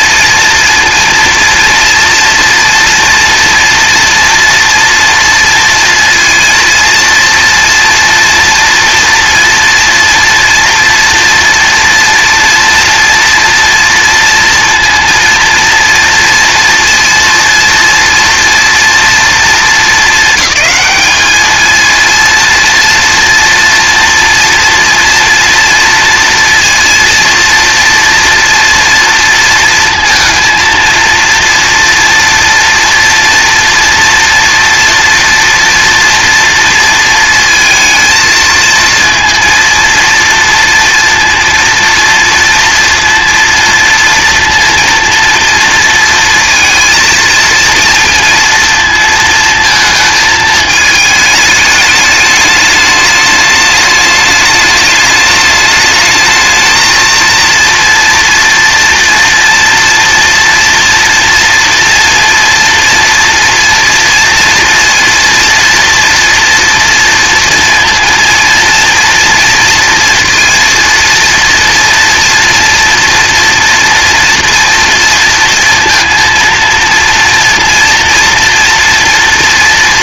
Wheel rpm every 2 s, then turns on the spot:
230, 240, 230, 230, 230, 230, 230, 230, 230, 230, 210, 230, 240, 230, 230, 230, 230, 240, 230, 230, 230, 230, 230, 230, 230, 220, 210, 210, 220, 230, 240, 240, 230, 230, 230, 230, 230, 230, 230, 230.
none